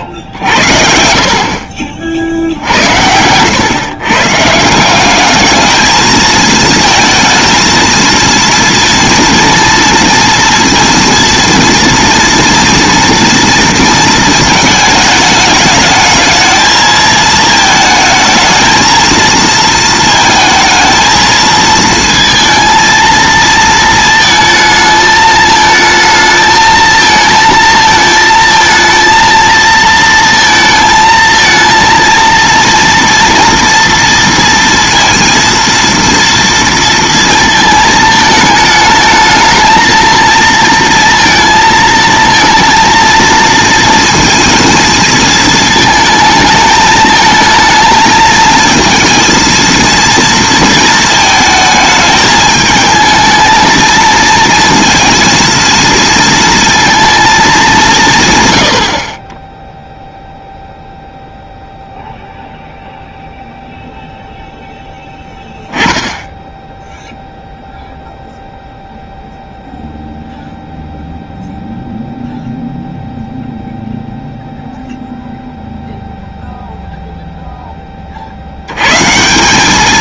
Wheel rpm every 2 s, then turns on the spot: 70, 60, 160, 220, 230, 230, 230, 220, 220, 220, 220, 230, 220, 220, 230, 230, 230, 230, 230, 220, 230, 230, 230, 220, 220, 230, 220, 230, 230, 110, 0, 0, 0, 10, 0, 0, 0, 0, 0, 90.
none